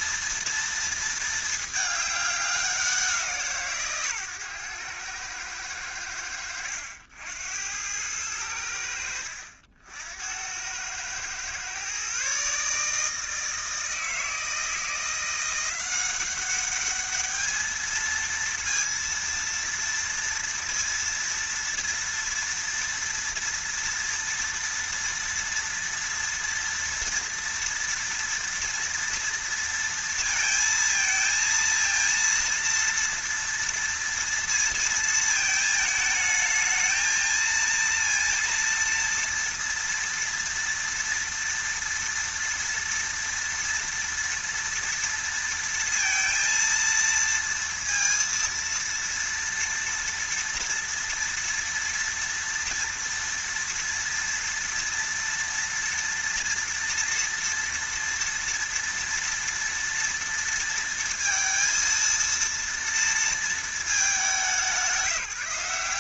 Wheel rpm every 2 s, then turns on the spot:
230, 180, 110, 80, 80, 100, 150, 160, 200, 230, 230, 230, 230, 240, 230, 230, 230, 230, 220, 230, 230, 230, 230, 230, 230, 230, 230, 230, 230, 230, 230, 230, 190.
none